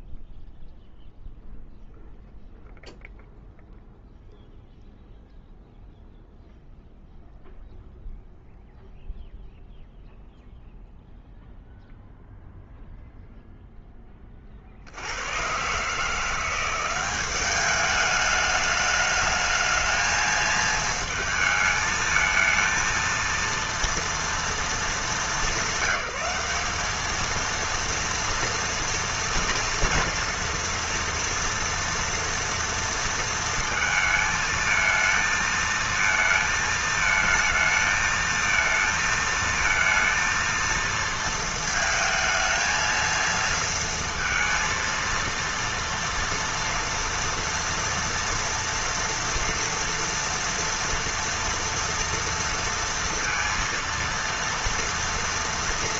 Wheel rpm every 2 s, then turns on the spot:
0, 0, 0, 0, 0, 0, 0, 60, 180, 210, 220, 220, 220, 210, 230, 230, 230, 220, 220, 220, 230, 230, 230, 230, 230, 230, 230, 230.
none